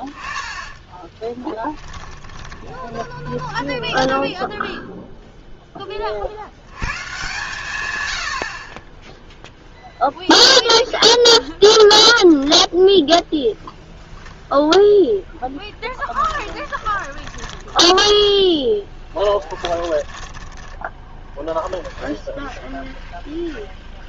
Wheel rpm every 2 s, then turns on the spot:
10, 10, 0, 100, 40, 0, 0, 0, 30, 10, 30, 10.
0-4 16-24